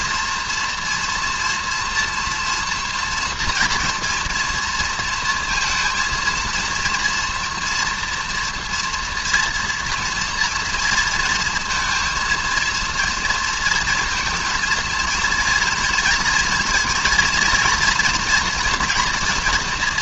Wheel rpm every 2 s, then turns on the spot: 230, 230, 230, 230, 230, 230, 230, 230, 230, 240.
none